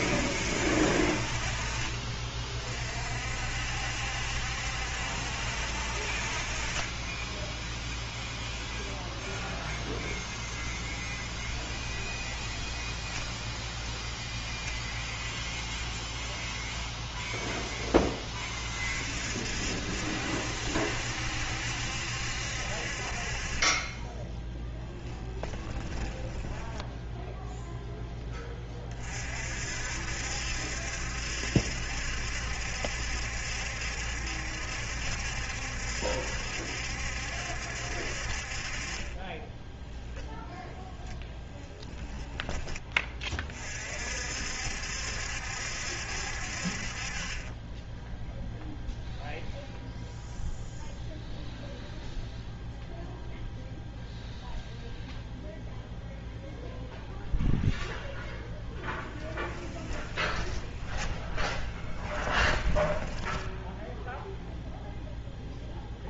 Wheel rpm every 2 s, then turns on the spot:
60, 50, 70, 30, 0, 0, 10, 0, 0, 40, 70, 50, 10, 10, 30, 70, 70, 70, 70, 30, 0, 10, 60, 40, 0, 0, 0, 0, 0, 10, 10, 10, 0.
12-14 24-28 60-64